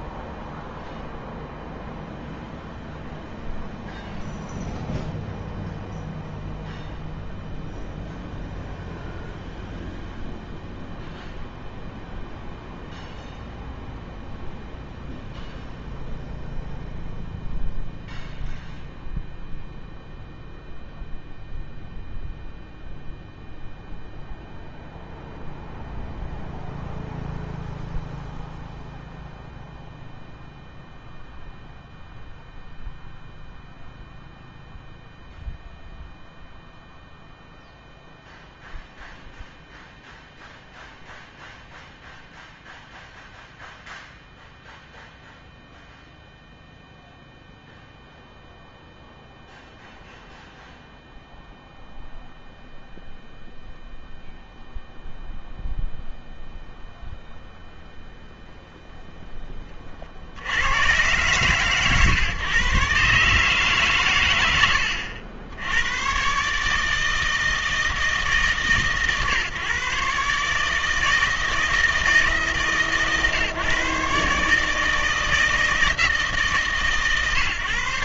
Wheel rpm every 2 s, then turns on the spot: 0, 0, 0, 0, 0, 0, 0, 0, 0, 0, 0, 0, 0, 0, 0, 0, 0, 0, 0, 0, 0, 0, 0, 0, 0, 0, 0, 0, 0, 0, 80, 130, 90, 140, 150, 150, 160, 150, 150.
none